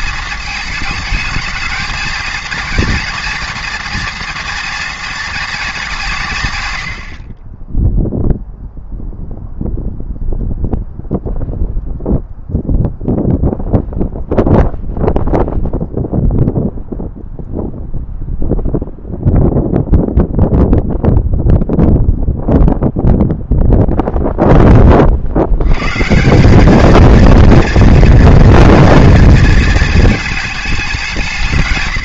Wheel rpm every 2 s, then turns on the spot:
220, 230, 230, 90, 0, 0, 0, 0, 0, 0, 0, 0, 30, 220, 230, 190.
none